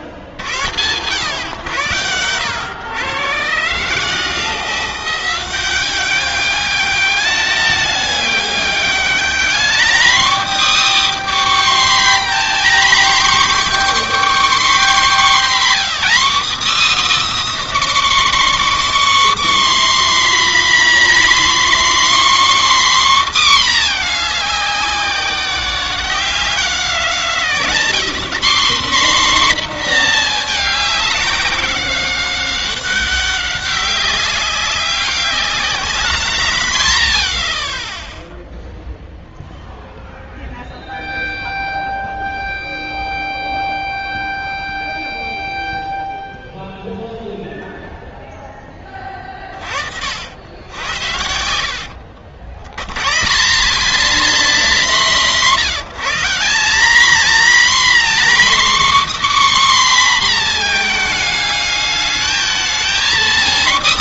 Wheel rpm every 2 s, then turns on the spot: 100, 110, 170, 200, 200, 290, 260, 280, 290, 290, 260, 270, 200, 180, 220, 220, 200, 190, 160, 0, 0, 0, 0, 0, 0, 40, 80, 220, 170, 260, 270, 210.
none